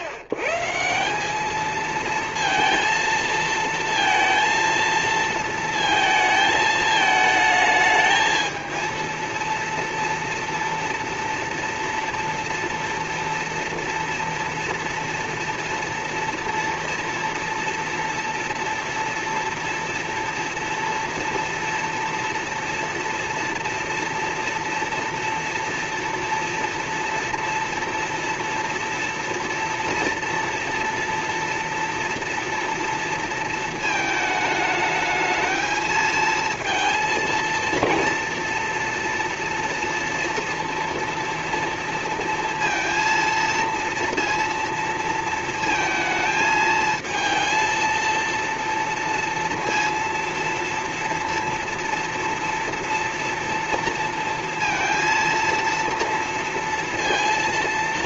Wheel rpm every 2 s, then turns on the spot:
130, 230, 230, 220, 220, 230, 230, 230, 230, 230, 240, 230, 230, 230, 230, 230, 230, 220, 230, 230, 230, 230, 230, 220, 230, 230, 230, 230, 230.
none